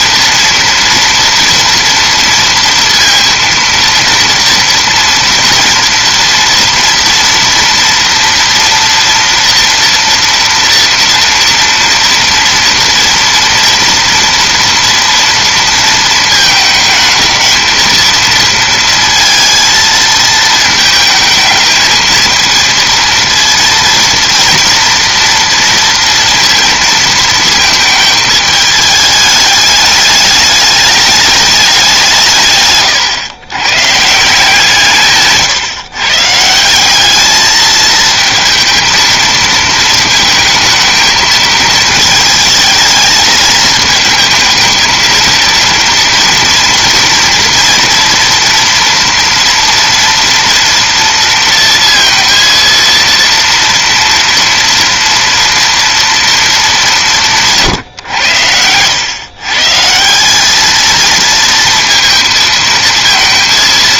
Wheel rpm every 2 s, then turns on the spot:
230, 230, 230, 230, 230, 230, 230, 230, 220, 230, 220, 230, 240, 230, 220, 210, 140, 170, 180, 230, 220, 220, 220, 230, 230, 230, 230, 230, 200, 90, 210, 230.
32-34